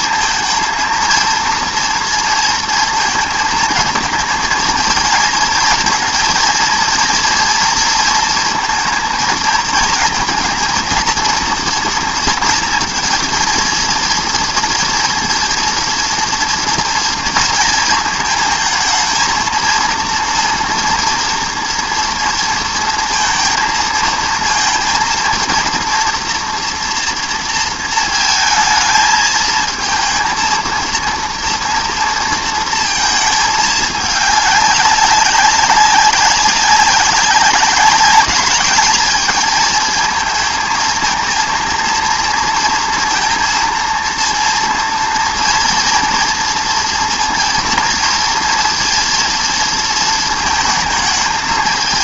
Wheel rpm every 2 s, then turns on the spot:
230, 230, 230, 230, 230, 230, 230, 230, 230, 220, 230, 230, 230, 230, 220, 230, 230, 210, 200, 210, 220, 230, 230, 230, 230, 230.
none